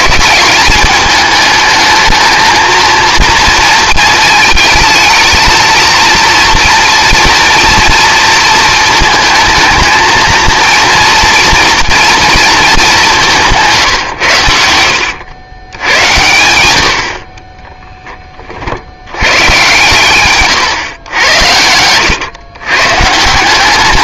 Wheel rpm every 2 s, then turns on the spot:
210, 220, 220, 230, 220, 230, 210, 90, 90, 40, 130, 130.
14-16